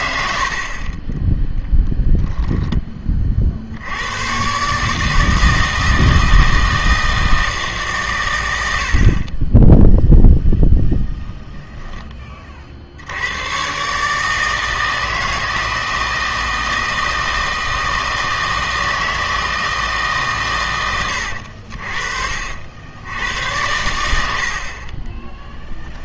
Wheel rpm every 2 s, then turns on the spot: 40, 10, 140, 160, 80, 0, 50, 160, 160, 160, 110, 70, 60.
24-26